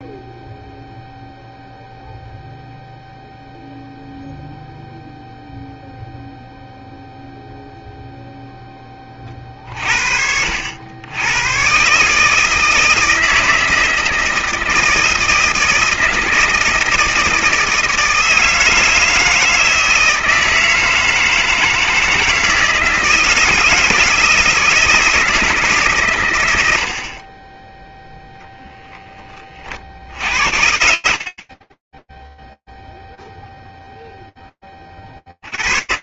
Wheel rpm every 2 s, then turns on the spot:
0, 0, 0, 0, 10, 80, 160, 160, 160, 160, 160, 160, 160, 80, 0, 70, 0, 20.
none